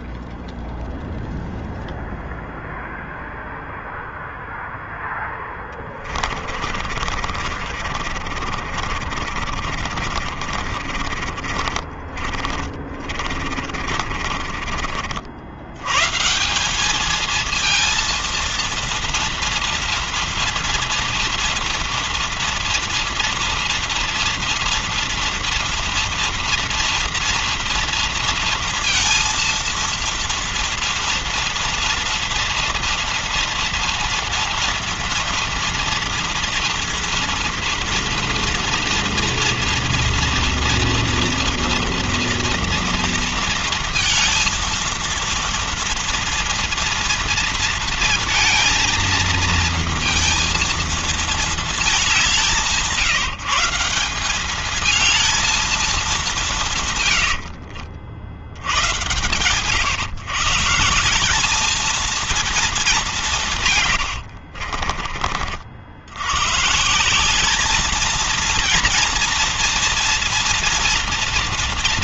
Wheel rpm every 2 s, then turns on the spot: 0, 0, 0, 30, 50, 40, 30, 50, 170, 230, 230, 230, 230, 230, 230, 230, 230, 230, 230, 230, 240, 230, 230, 230, 230, 230, 180, 200, 190, 70, 160, 220, 60, 110, 230, 230.
6-16 64-66